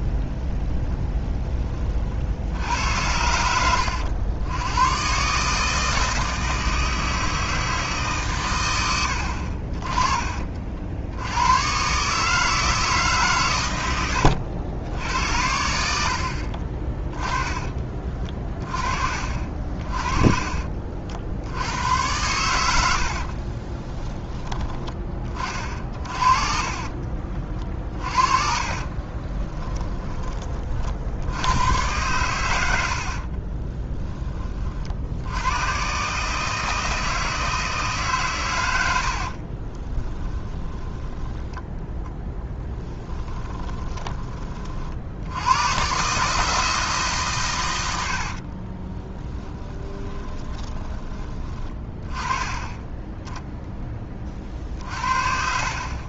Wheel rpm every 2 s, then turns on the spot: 0, 80, 110, 160, 50, 60, 160, 80, 20, 40, 50, 70, 20, 40, 40, 50, 80, 60, 160, 90, 10, 10, 50, 160, 30, 20, 10, 50.
26-30 32-34 42-44 48-50